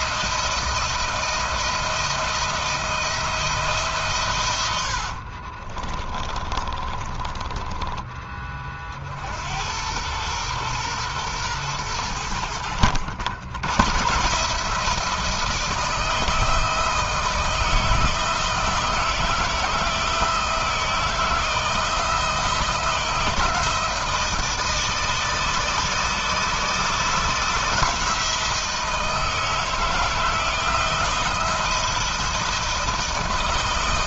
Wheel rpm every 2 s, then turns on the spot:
170, 170, 60, 20, 60, 120, 90, 160, 160, 160, 160, 160, 160, 160, 160, 170, 170.
4-8